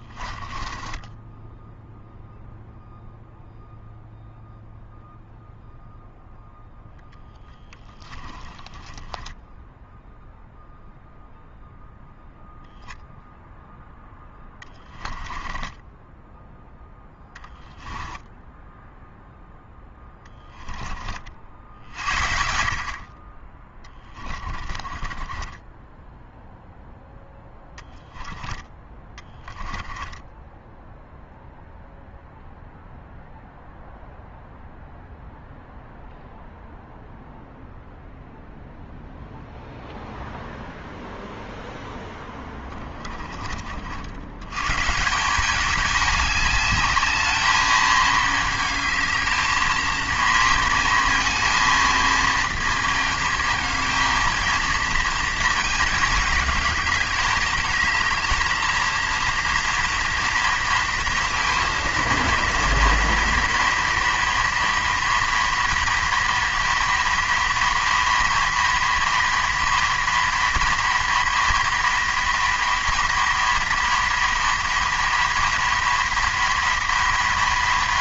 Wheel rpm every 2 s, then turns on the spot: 20, 0, 0, 0, 10, 0, 0, 10, 0, 10, 20, 50, 30, 10, 20, 10, 0, 0, 0, 0, 0, 20, 130, 210, 220, 230, 230, 230, 210, 230, 230, 230, 230, 230, 230, 230, 230, 230, 230.
0-2 8-10 14-16 18-20 22-26 30-32 42-44